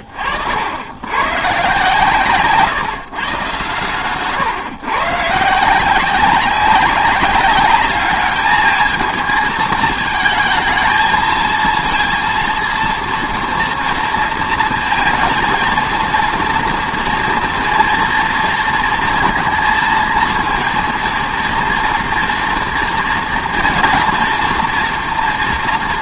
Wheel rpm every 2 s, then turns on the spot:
70, 150, 120, 190, 220, 220, 230, 230, 230, 230, 230, 230, 230.
none